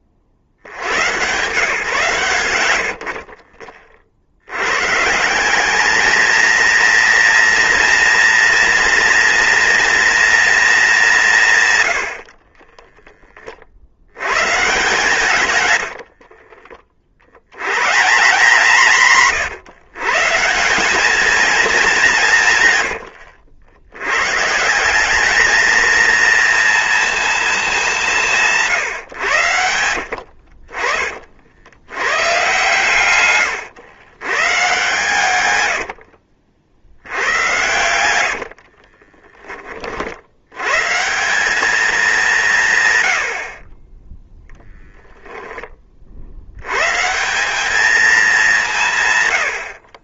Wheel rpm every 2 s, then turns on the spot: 80, 80, 110, 230, 230, 220, 20, 130, 50, 160, 180, 110, 170, 230, 140, 50, 120, 130, 60, 50, 130, 140, 10, 120, 170.
12-14 22-24 38-40